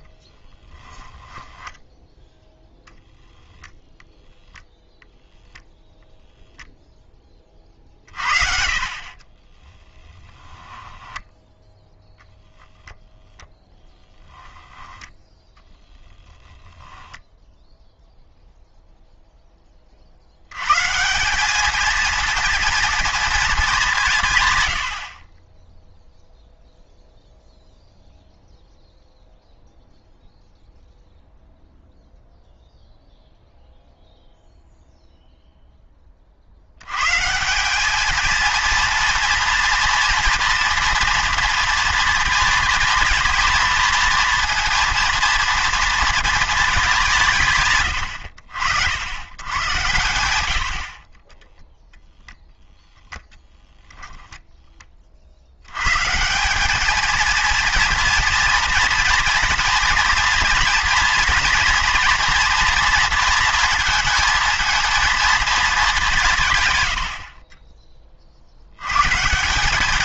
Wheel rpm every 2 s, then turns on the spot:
20, 0, 0, 0, 50, 10, 0, 10, 10, 0, 110, 230, 100, 0, 0, 0, 0, 0, 80, 230, 230, 230, 230, 220, 70, 80, 0, 10, 210, 230, 230, 230, 230, 120, 70.
0-2 10-12